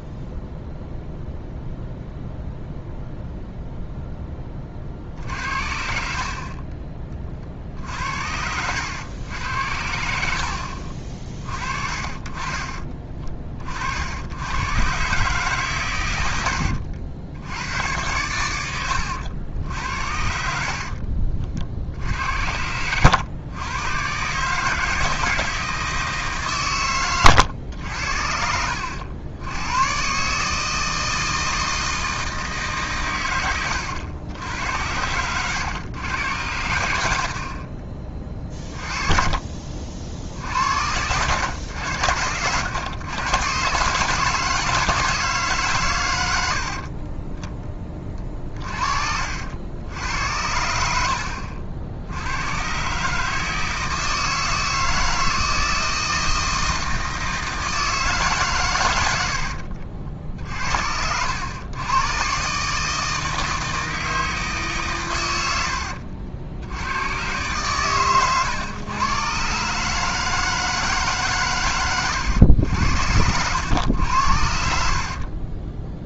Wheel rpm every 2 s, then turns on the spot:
0, 0, 30, 30, 90, 60, 30, 110, 90, 90, 60, 80, 150, 130, 70, 150, 150, 80, 90, 30, 70, 100, 160, 70, 40, 80, 120, 160, 160, 130, 60, 150, 140, 90, 120, 150, 80, 60.
16-18 20-24 36-40 46-48 74-76